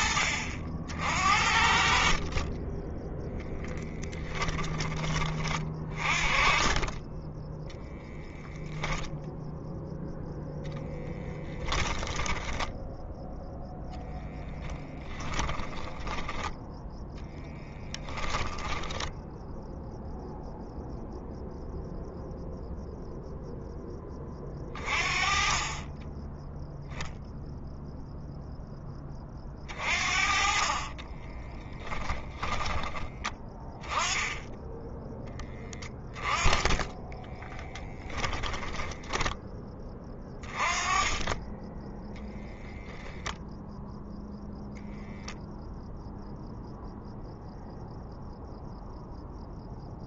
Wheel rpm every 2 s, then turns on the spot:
60, 10, 20, 20, 0, 0, 0, 10, 10, 10, 0, 0, 30, 0, 20, 30, 20, 10, 20, 20, 20, 10, 0, 0, 0.
14-20 30-32 36-40